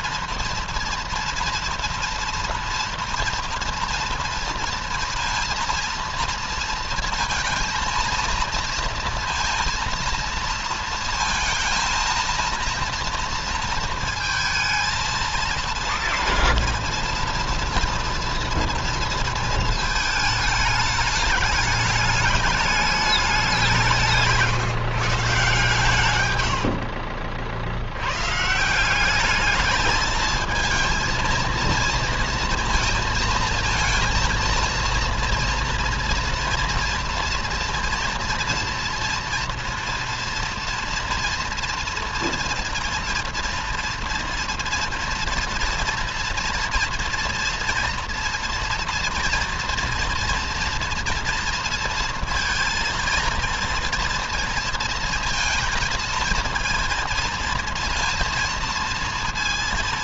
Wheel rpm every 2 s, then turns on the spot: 230, 230, 230, 230, 230, 230, 230, 230, 230, 230, 210, 200, 150, 60, 180, 230, 230, 230, 230, 230, 240, 230, 230, 230, 230, 230, 230, 230, 230, 230.
26-28